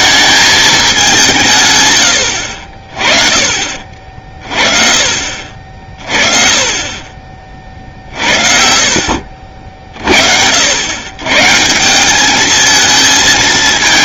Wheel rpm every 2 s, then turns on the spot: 190, 40, 40, 40, 60, 100, 220.
6-10